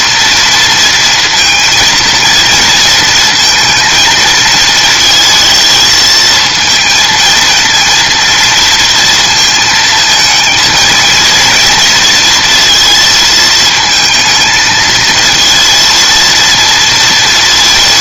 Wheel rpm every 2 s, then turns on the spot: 230, 230, 220, 230, 230, 230, 230, 220, 230.
none